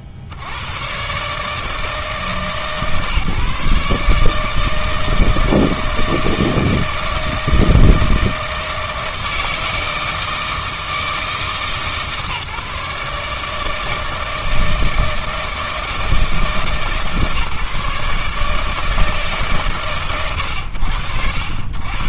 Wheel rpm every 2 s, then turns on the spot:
60, 150, 160, 160, 160, 160, 150, 160, 160, 150, 100.
none